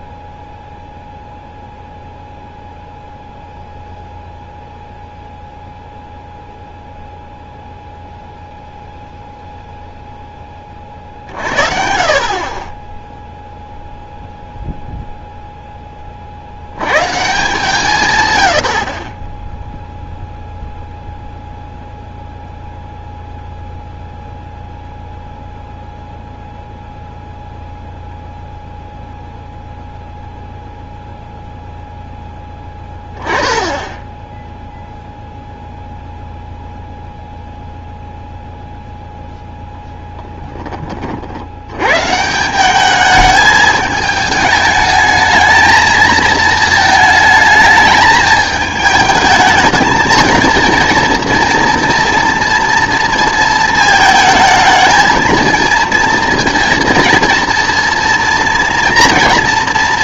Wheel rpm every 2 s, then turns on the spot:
0, 0, 0, 0, 0, 30, 30, 0, 90, 70, 0, 0, 0, 0, 0, 0, 10, 0, 0, 0, 20, 190, 210, 220, 210, 230, 230, 230, 230, 240.
none